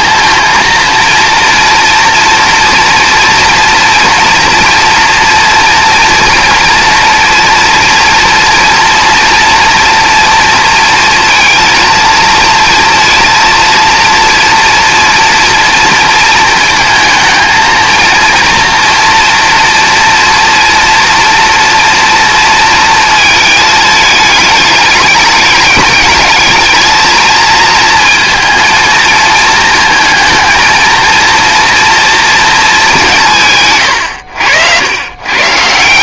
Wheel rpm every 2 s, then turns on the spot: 230, 230, 230, 240, 230, 230, 230, 230, 230, 230, 240, 230, 210, 220, 230, 230, 220, 90.
none